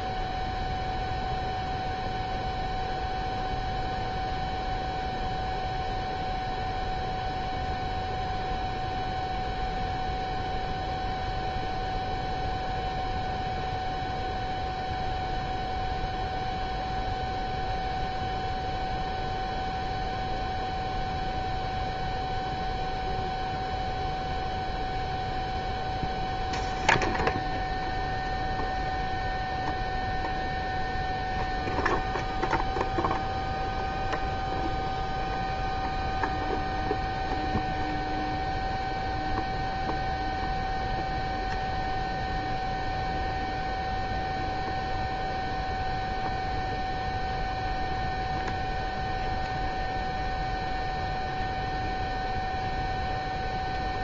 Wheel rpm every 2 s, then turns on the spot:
0, 0, 0, 0, 0, 0, 0, 0, 0, 0, 0, 0, 0, 0, 0, 0, 0, 0, 0, 0, 0, 0, 0, 0, 0, 0, 0.
none